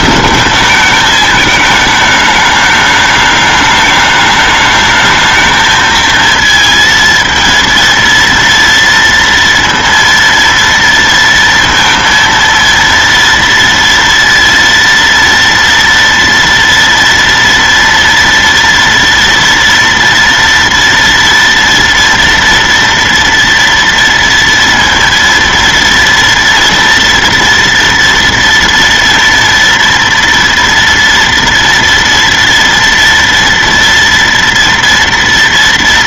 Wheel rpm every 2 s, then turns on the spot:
210, 210, 210, 220, 230, 230, 230, 230, 230, 230, 230, 230, 230, 230, 230, 230, 230, 230.
none